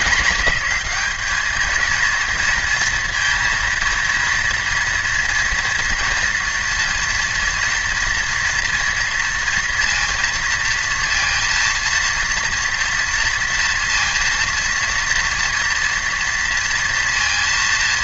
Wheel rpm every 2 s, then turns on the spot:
210, 230, 230, 230, 230, 230, 230, 230, 230.
none